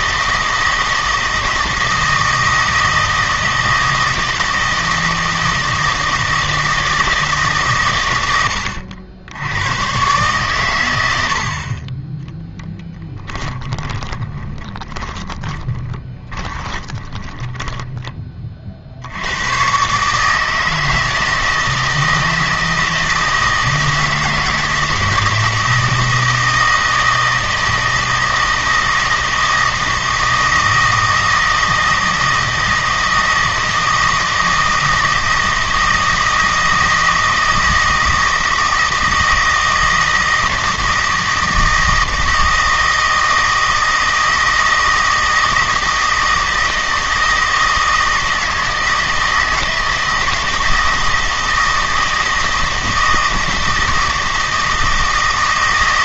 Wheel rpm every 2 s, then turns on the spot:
160, 160, 160, 160, 90, 110, 20, 10, 20, 50, 160, 160, 160, 160, 160, 160, 160, 160, 160, 160, 160, 160, 160, 160, 160, 160, 160, 160.
12-18